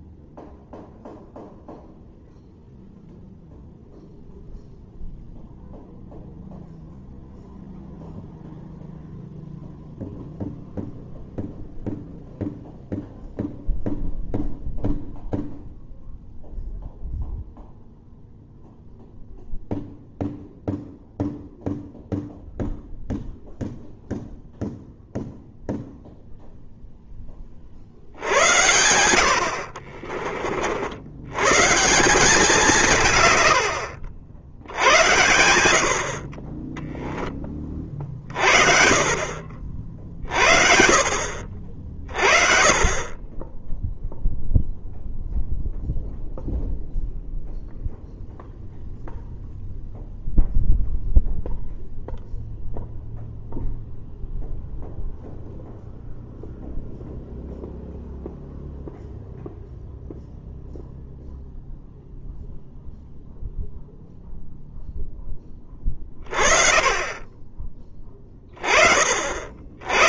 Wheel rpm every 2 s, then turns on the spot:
0, 0, 0, 0, 0, 0, 0, 0, 0, 0, 0, 0, 0, 0, 80, 60, 170, 80, 10, 40, 40, 40, 0, 0, 0, 0, 0, 0, 0, 0, 0, 0, 0, 40, 20.
none